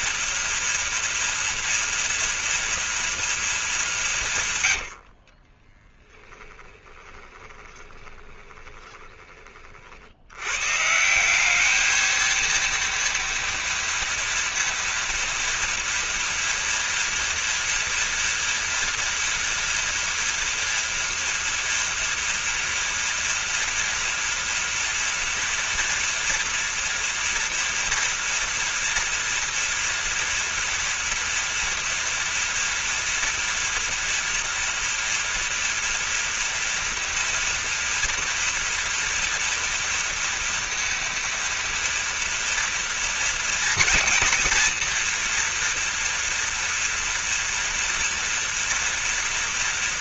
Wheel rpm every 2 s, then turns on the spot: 230, 230, 90, 10, 20, 150, 230, 230, 230, 230, 230, 230, 230, 230, 230, 230, 230, 240, 230, 230, 230, 230, 240, 230, 230.
4-10